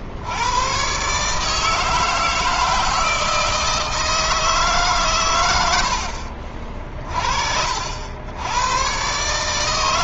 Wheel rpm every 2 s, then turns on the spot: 130, 160, 150, 50, 110.
none